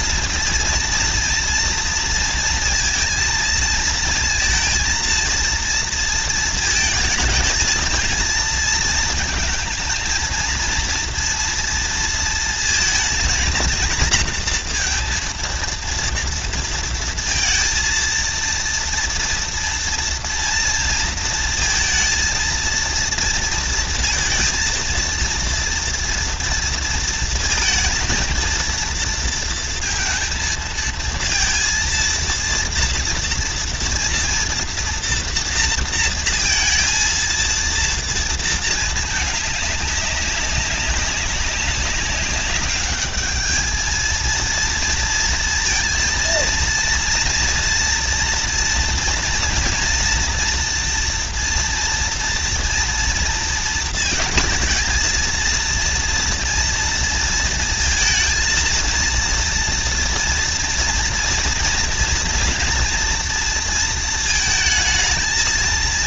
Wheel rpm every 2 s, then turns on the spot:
230, 230, 230, 220, 230, 230, 230, 230, 230, 230, 230, 230, 230, 230, 230, 230, 230, 230, 230, 230, 200, 200, 230, 230, 230, 230, 230, 220, 230, 230, 230, 230, 220.
none